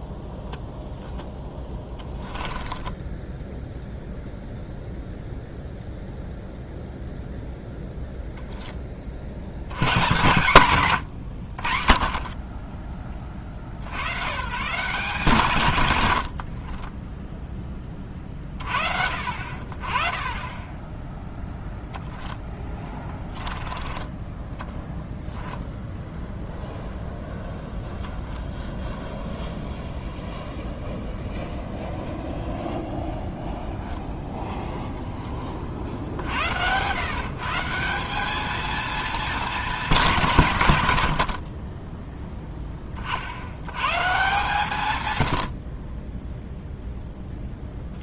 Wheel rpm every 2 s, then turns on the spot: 0, 20, 0, 0, 10, 130, 30, 160, 30, 50, 10, 10, 10, 0, 0, 0, 0, 0, 110, 220, 130, 30, 130, 0.
2-4 16-18 22-26